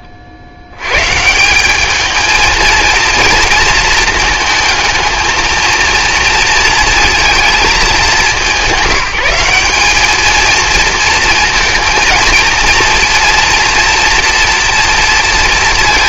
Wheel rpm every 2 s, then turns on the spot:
90, 220, 220, 230, 190, 220, 230, 230.
none